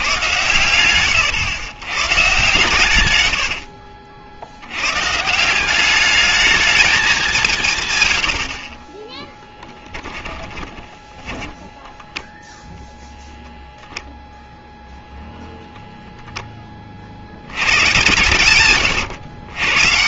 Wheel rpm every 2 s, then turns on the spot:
120, 130, 80, 210, 70, 20, 0, 0, 10, 120.
10-12